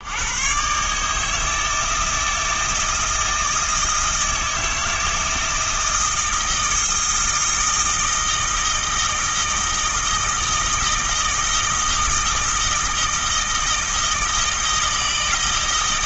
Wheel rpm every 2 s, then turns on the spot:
150, 160, 160, 160, 160, 160, 160, 160.
none